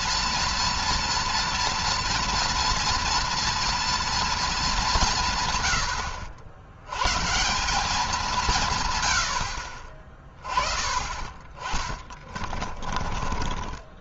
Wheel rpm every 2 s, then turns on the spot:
230, 230, 200, 110, 150, 30, 20.
12-14